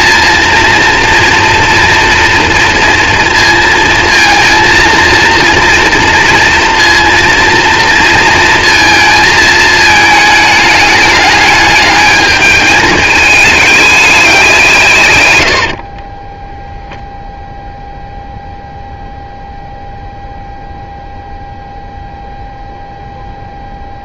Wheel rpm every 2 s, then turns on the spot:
230, 230, 230, 230, 230, 210, 220, 180, 0, 0, 0, 0.
none